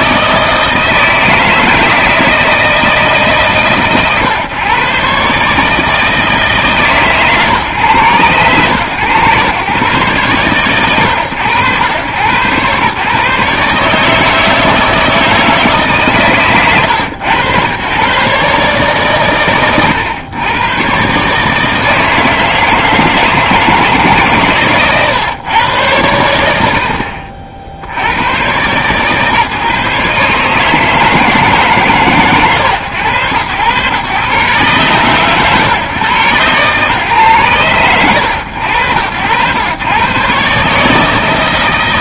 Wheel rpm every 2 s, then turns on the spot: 160, 160, 130, 150, 110, 100, 130, 160, 120, 150, 120, 160, 130, 70, 120, 150, 120, 120, 130, 100, 150.
16-18